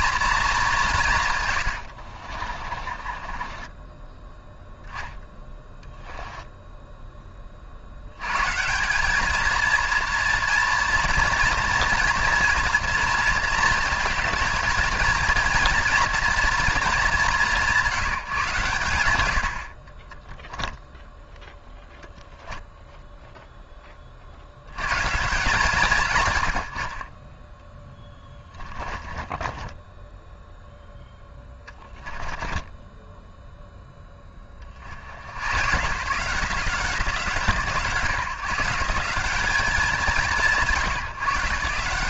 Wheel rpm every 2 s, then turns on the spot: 170, 30, 10, 10, 180, 230, 230, 220, 200, 110, 0, 0, 120, 50, 20, 10, 10, 90, 170, 160, 150.
2-4 28-30 32-34